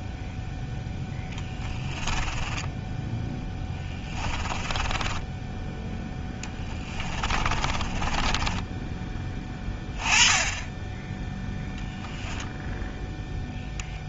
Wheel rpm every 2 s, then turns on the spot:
0, 10, 20, 10, 10, 10, 0.
2-8